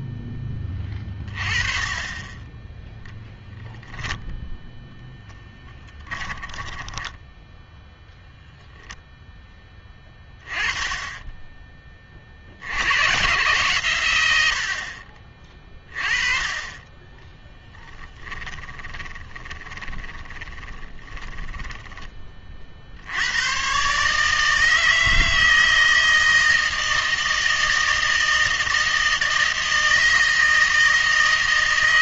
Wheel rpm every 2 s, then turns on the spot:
20, 10, 10, 20, 10, 20, 80, 70, 20, 20, 20, 50, 160, 160, 160, 160.
6-8 18-22